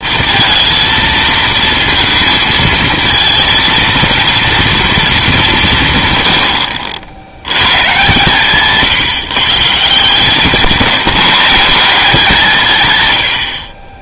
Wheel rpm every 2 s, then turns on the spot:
230, 230, 230, 80, 140, 160, 160.
none